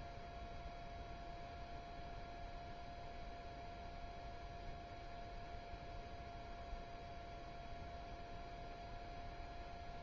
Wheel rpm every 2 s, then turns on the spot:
0, 0, 0, 0, 0.
none